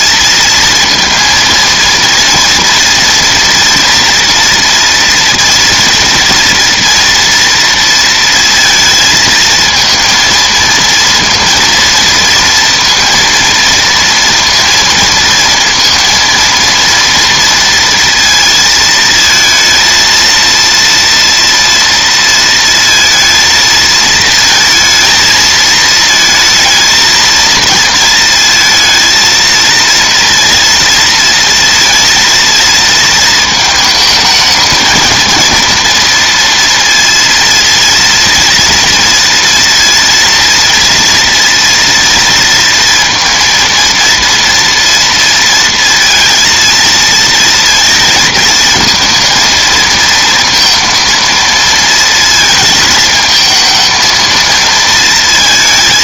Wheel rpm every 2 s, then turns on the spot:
230, 230, 230, 230, 230, 230, 230, 230, 230, 220, 230, 230, 230, 230, 230, 230, 230, 220, 230, 230, 230, 230, 230, 230, 220, 230, 220, 220.
none